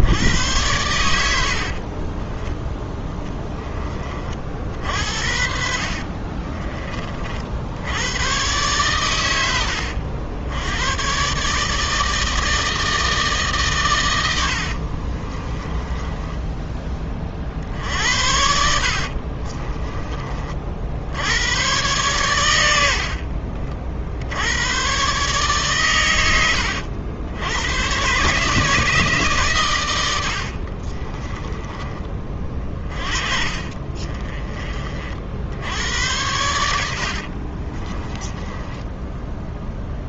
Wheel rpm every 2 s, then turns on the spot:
100, 10, 60, 30, 120, 110, 160, 50, 20, 60, 70, 70, 120, 90, 160, 40, 30, 40, 70, 10.
14-16 18-20 30-34 36-40